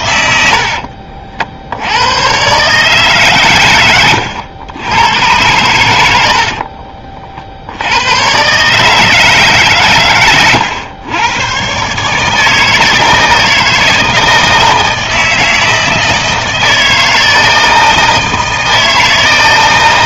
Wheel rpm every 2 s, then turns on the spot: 60, 140, 90, 50, 140, 110, 160, 160, 160, 160.
0-2 6-8